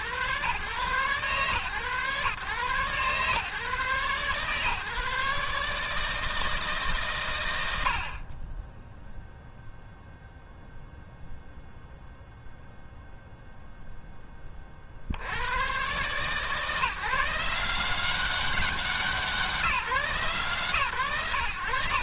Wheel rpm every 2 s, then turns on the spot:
130, 130, 140, 150, 10, 0, 0, 40, 150, 190, 150.
none